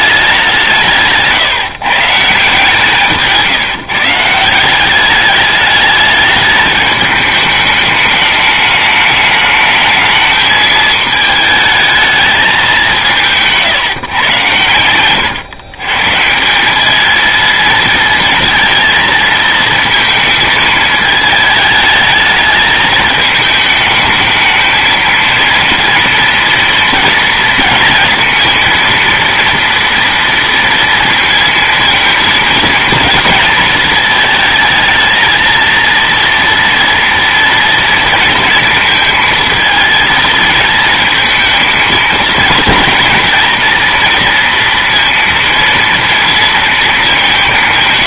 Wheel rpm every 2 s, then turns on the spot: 170, 160, 170, 210, 210, 220, 200, 110, 200, 220, 220, 210, 220, 230, 230, 230, 230, 220, 230, 230, 220, 220, 230, 230.
none